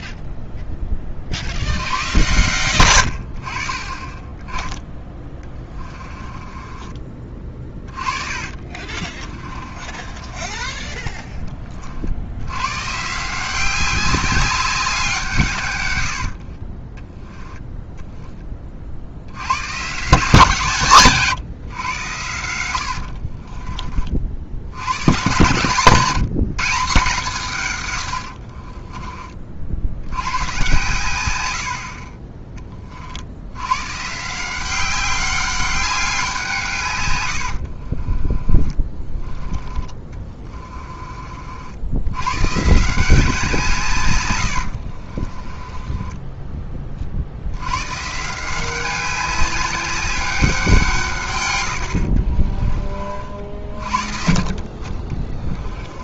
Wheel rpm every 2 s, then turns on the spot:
10, 80, 20, 20, 40, 10, 110, 190, 40, 30, 150, 90, 80, 180, 50, 130, 30, 180, 160, 30, 20, 130, 90, 20, 170, 190, 30, 50.
6-12 16-18 22-24 28-30 38-42 44-48 52-54